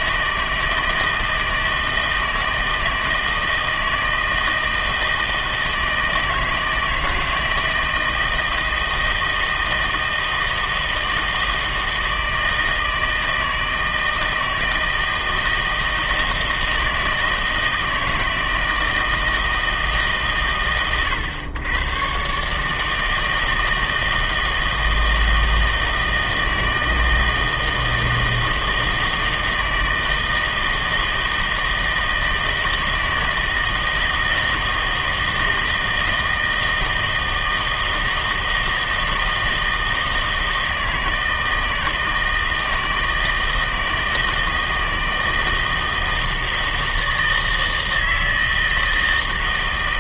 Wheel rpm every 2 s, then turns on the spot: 160, 160, 160, 160, 170, 160, 160, 160, 160, 160, 130, 150, 160, 160, 160, 160, 160, 160, 160, 160, 160, 160, 160, 160, 160.
none